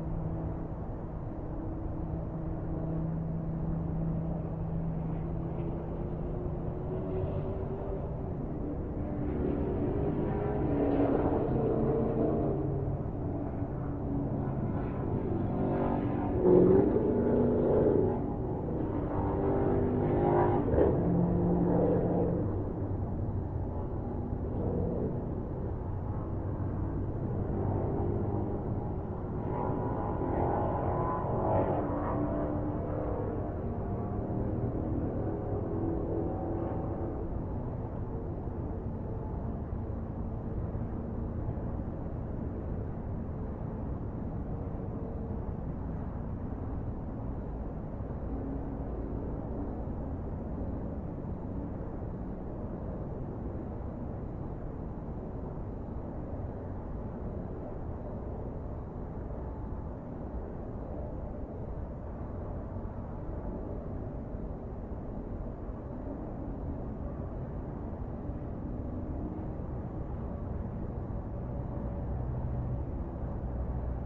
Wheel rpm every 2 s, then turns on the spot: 0, 0, 0, 0, 0, 0, 0, 0, 0, 0, 0, 0, 0, 0, 0, 0, 0, 0, 0, 0, 0, 0, 0, 0, 0, 0, 0, 0, 0, 0, 0, 0, 0, 0, 0, 0, 0.
none